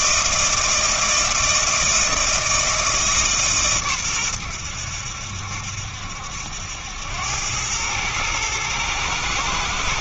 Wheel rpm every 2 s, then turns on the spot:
160, 160, 90, 80, 110.
none